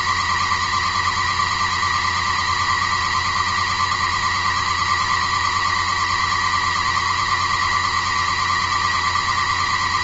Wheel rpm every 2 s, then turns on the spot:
130, 130, 130, 130, 130.
none